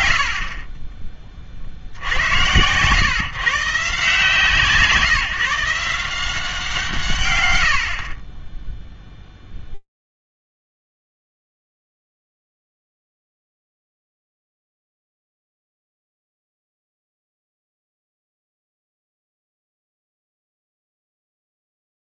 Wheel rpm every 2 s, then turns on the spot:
60, 110, 160, 170, 10, 0, 0, 0, 0, 0, 0.
8-10